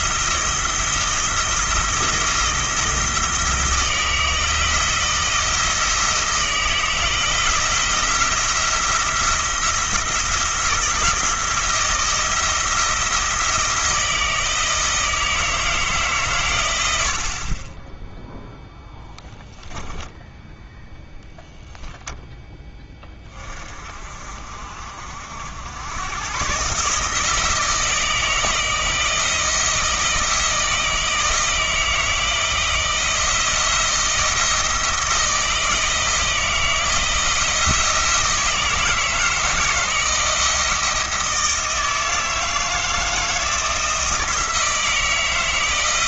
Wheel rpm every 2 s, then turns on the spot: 170, 160, 160, 160, 170, 170, 170, 160, 90, 0, 0, 20, 50, 150, 160, 160, 170, 160, 160, 160, 160, 160, 160.
none